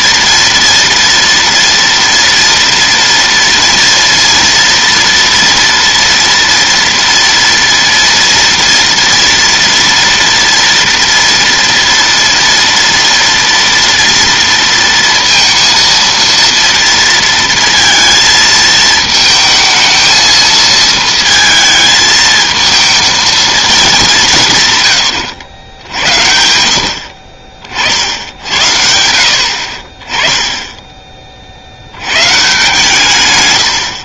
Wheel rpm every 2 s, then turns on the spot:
230, 230, 230, 230, 230, 230, 230, 230, 230, 220, 220, 220, 120, 70, 80, 10, 140.
none